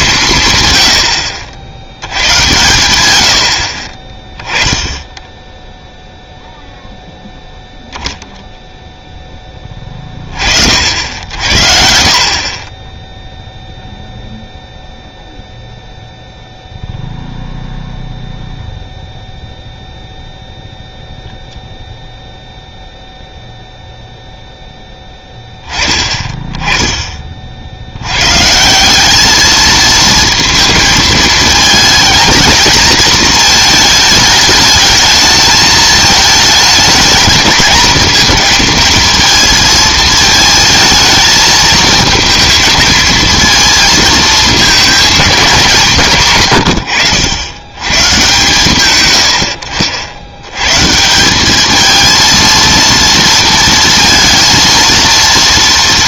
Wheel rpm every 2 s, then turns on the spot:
120, 110, 10, 0, 0, 50, 20, 0, 0, 0, 0, 0, 0, 10, 160, 220, 230, 220, 220, 220, 220, 230, 220, 110, 100, 120, 230, 230.
none